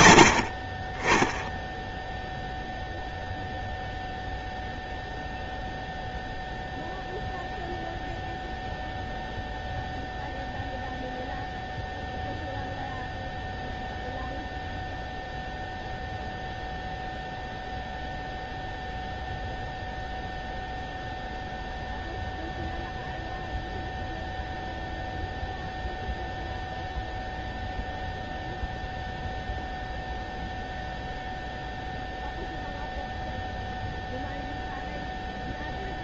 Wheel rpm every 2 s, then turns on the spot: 20, 0, 0, 0, 0, 0, 0, 0, 0, 0, 0, 0, 0, 0, 0, 0, 0, 0.
none